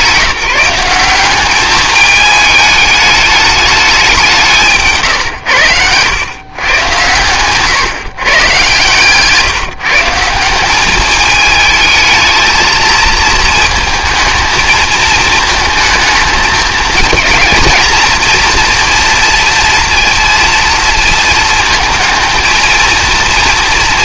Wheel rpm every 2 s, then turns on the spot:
190, 210, 150, 120, 140, 200, 220, 220, 220, 230, 230, 220.
4-6 8-10